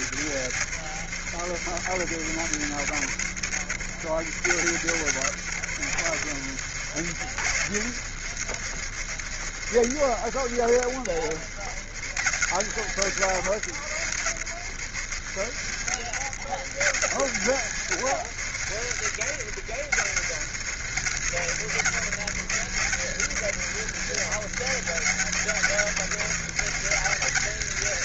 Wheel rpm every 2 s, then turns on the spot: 80, 70, 80, 80, 80, 70, 90, 80, 90, 90, 90, 80, 90, 100.
none